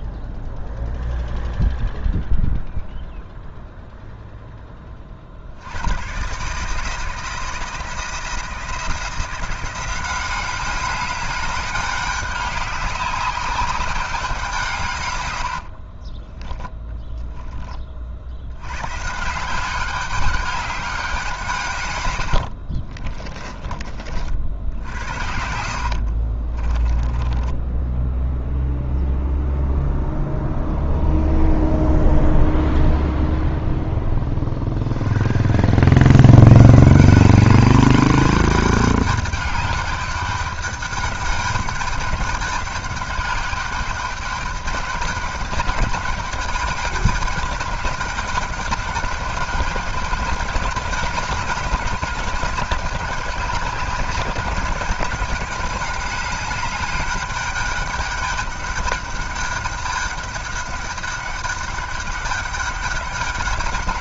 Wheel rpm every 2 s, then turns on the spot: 0, 0, 20, 150, 170, 200, 200, 150, 10, 110, 200, 50, 70, 30, 0, 0, 0, 50, 170, 210, 200, 200, 200, 210, 200, 200, 200, 200, 200, 200, 200, 200.
16-18 22-28